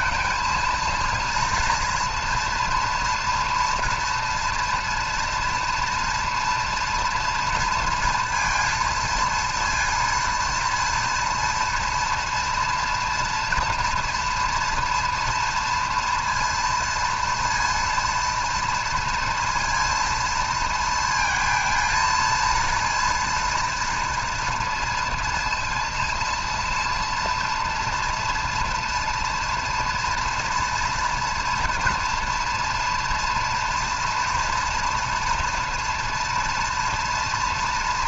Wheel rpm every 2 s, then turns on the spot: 230, 230, 240, 240, 230, 230, 240, 230, 230, 230, 230, 230, 240, 230, 230, 240, 240, 230, 230.
none